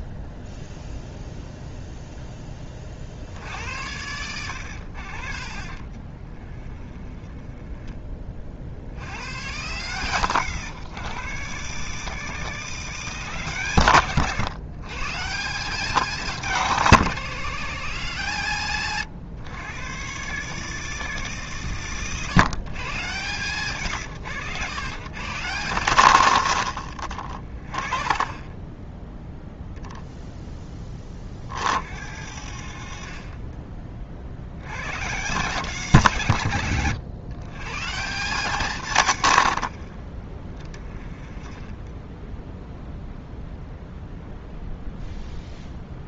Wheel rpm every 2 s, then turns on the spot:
0, 30, 80, 30, 70, 140, 190, 130, 190, 150, 190, 130, 110, 70, 20, 20, 60, 100, 150, 140, 20, 0, 0.
6-8